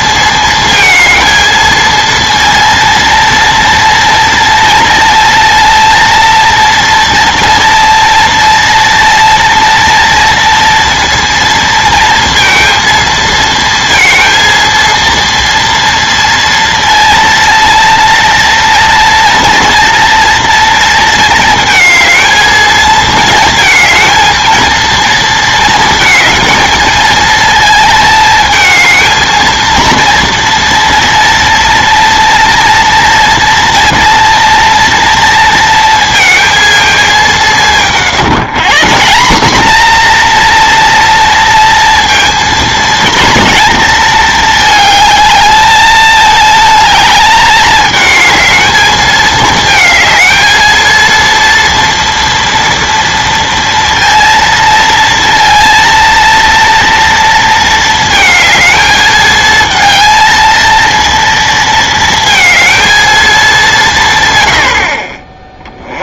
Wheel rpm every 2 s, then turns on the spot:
220, 230, 230, 230, 230, 230, 230, 230, 230, 230, 230, 220, 230, 220, 220, 230, 230, 230, 220, 180, 240, 230, 220, 220, 220, 230, 230, 230, 230, 220, 230, 230, 60.
none